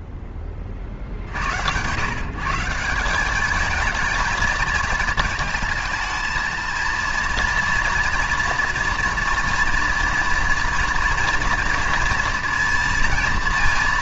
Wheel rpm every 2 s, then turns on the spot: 60, 210, 220, 230, 230, 230, 230.
none